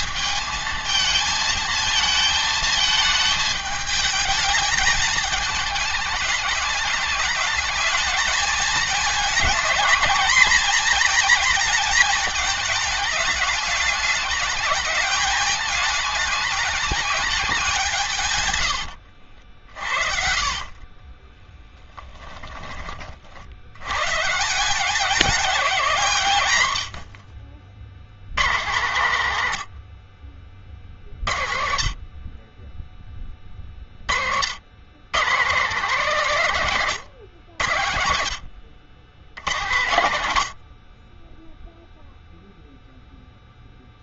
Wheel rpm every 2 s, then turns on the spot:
220, 220, 220, 210, 220, 220, 210, 210, 210, 110, 40, 20, 180, 100, 130, 50, 20, 100, 160, 90, 80, 0.
20-22